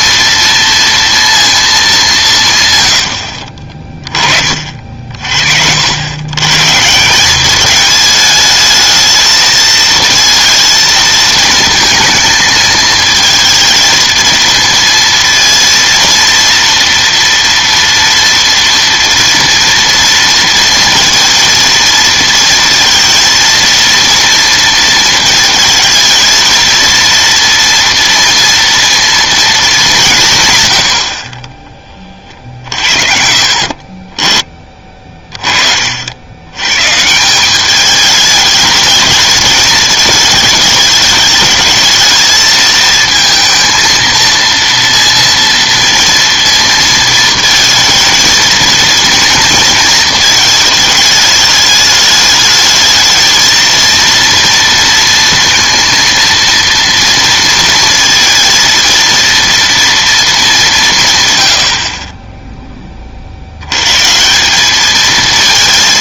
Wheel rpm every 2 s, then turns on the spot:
230, 140, 40, 140, 220, 220, 220, 230, 230, 230, 230, 230, 230, 230, 230, 120, 50, 20, 110, 210, 220, 220, 230, 230, 230, 220, 220, 230, 230, 230, 190, 10, 200.
none